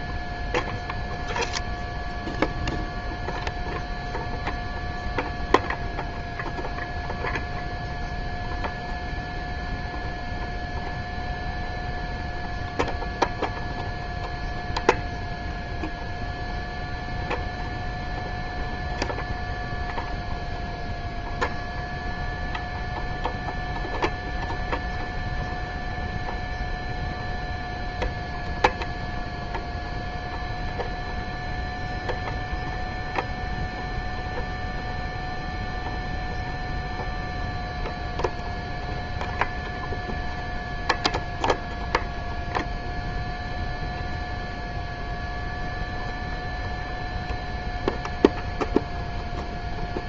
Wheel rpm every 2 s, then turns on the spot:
0, 0, 0, 0, 0, 0, 0, 0, 0, 0, 0, 0, 0, 0, 0, 0, 0, 0, 0, 0, 0, 0, 0, 0, 0.
none